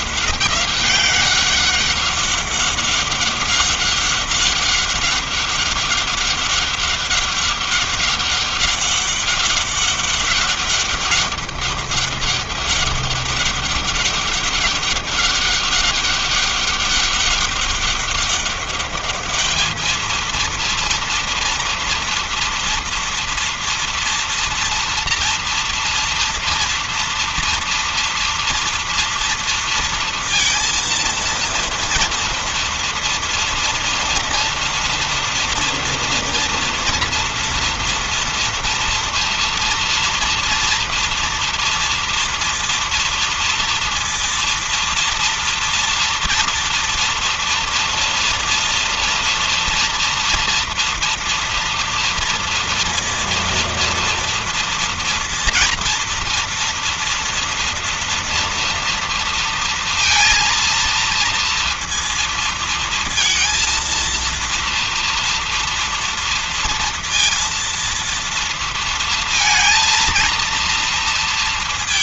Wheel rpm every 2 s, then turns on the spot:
190, 190, 200, 190, 190, 190, 200, 200, 200, 200, 230, 230, 230, 230, 230, 230, 230, 230, 230, 230, 230, 230, 230, 240, 240, 230, 230, 230, 230, 240, 230, 230, 230, 230, 230, 230.
none